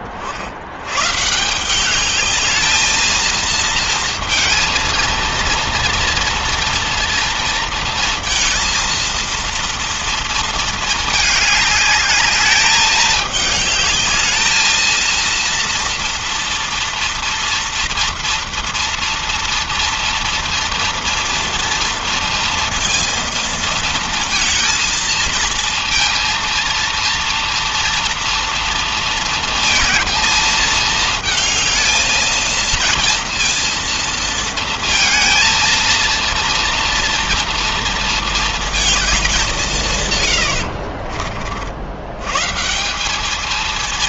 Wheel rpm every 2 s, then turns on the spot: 130, 220, 230, 230, 230, 220, 220, 230, 230, 230, 230, 230, 230, 230, 230, 220, 230, 230, 230, 200, 50, 200.
none